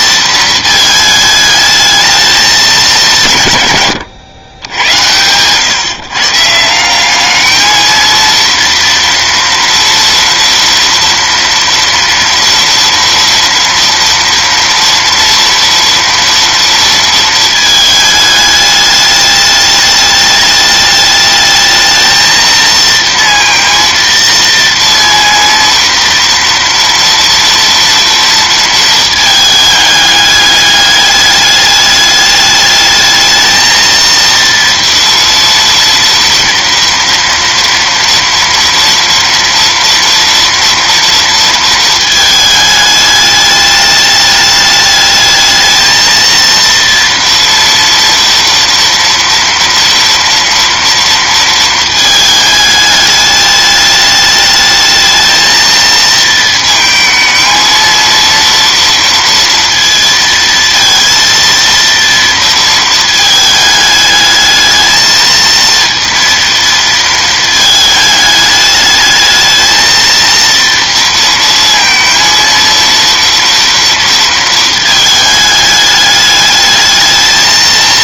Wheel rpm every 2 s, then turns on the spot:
220, 150, 100, 200, 230, 240, 230, 240, 230, 210, 210, 230, 230, 230, 220, 210, 220, 230, 230, 230, 230, 210, 220, 230, 230, 230, 210, 220, 220, 230, 230, 220, 220, 220, 220, 230, 230, 220, 220.
none